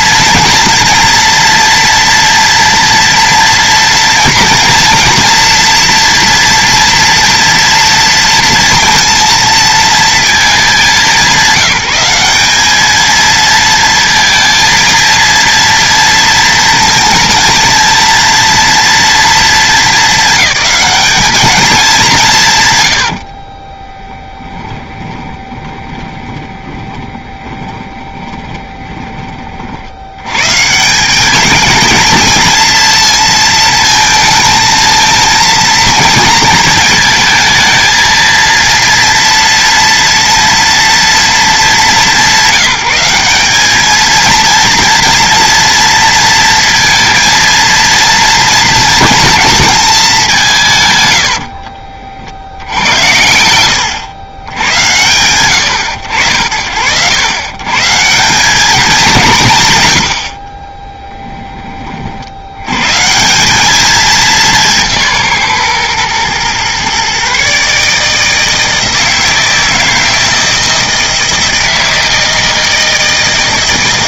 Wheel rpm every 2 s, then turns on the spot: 230, 230, 230, 230, 230, 200, 210, 230, 230, 230, 200, 110, 20, 30, 20, 170, 230, 230, 220, 230, 230, 200, 230, 230, 230, 130, 70, 100, 90, 190, 10, 100, 170, 130, 160, 160, 160.
22-30 50-52 60-62